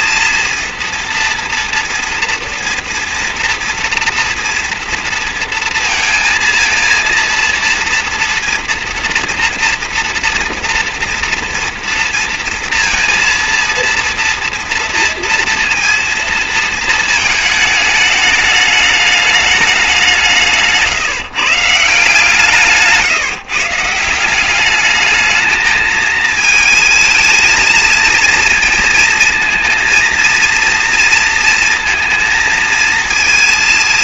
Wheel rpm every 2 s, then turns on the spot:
230, 230, 230, 230, 230, 230, 230, 230, 230, 210, 170, 150, 190, 220, 230, 230, 230.
none